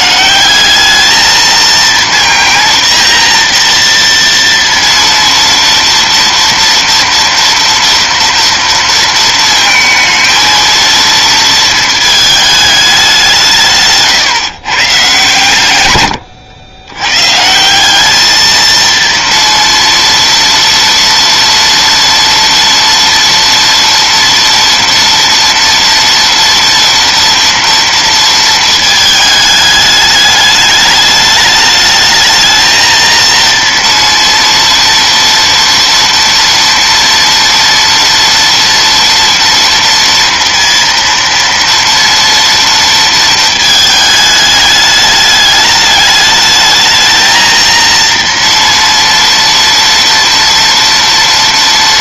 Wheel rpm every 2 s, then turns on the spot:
220, 230, 230, 230, 230, 230, 170, 130, 160, 230, 230, 230, 230, 230, 210, 210, 230, 230, 230, 230, 230, 220, 210, 230, 230, 230.
none